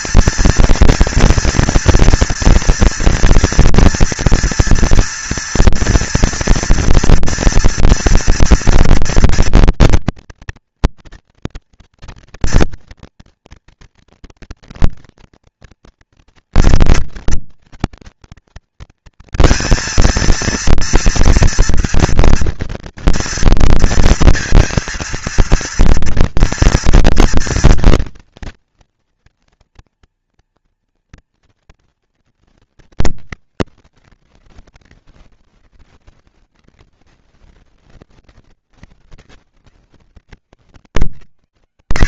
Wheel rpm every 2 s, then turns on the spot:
230, 230, 230, 240, 240, 230, 230, 230, 230, 230, 240, 230, 230, 230, 240, 210, 130, 110, 100, 120, 120.
none